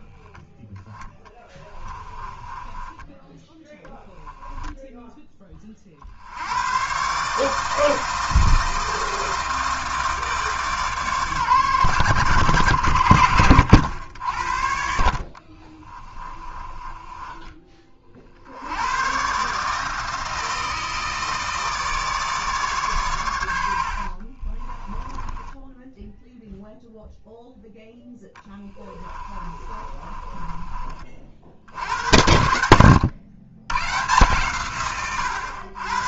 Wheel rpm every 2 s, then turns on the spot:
10, 20, 10, 110, 160, 150, 100, 70, 20, 90, 160, 140, 20, 0, 20, 20, 90, 130.
2-4 14-18 24-26 28-30